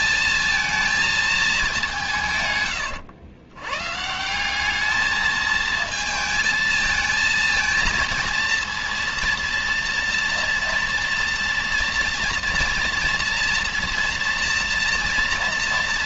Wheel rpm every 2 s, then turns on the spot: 220, 130, 180, 220, 230, 230, 230, 230.
none